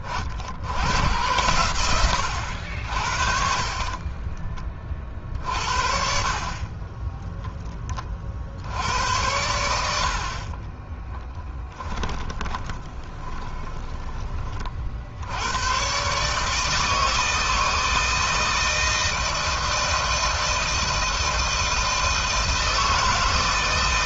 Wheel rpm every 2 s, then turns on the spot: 70, 60, 40, 30, 80, 30, 20, 50, 160, 160, 160, 160.
10-14